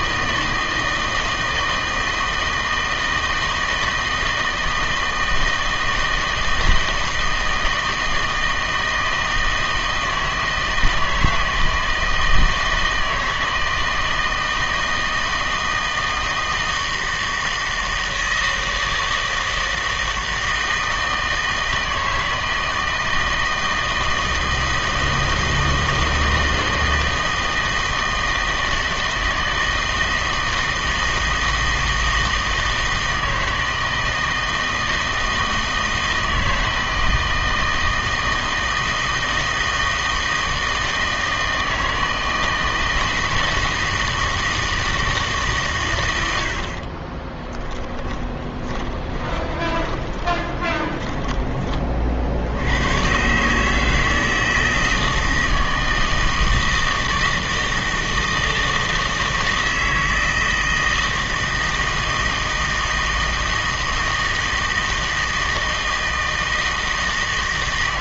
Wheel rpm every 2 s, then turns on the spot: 160, 160, 160, 160, 160, 160, 160, 160, 160, 160, 160, 160, 160, 160, 160, 160, 160, 160, 160, 160, 160, 160, 160, 70, 20, 30, 70, 160, 160, 160, 160, 160, 160, 160.
48-52